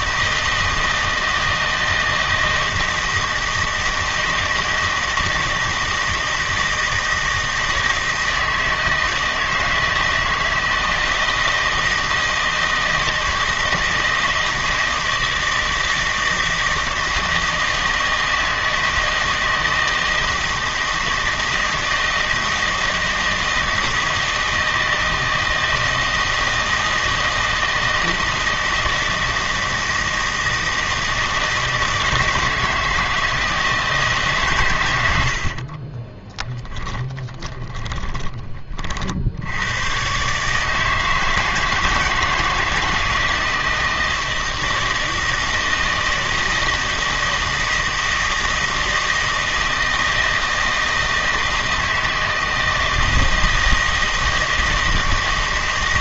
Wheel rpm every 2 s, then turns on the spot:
160, 160, 160, 160, 160, 160, 160, 160, 160, 160, 160, 160, 160, 160, 160, 160, 160, 110, 20, 40, 160, 160, 160, 160, 160, 160, 160, 160.
36-38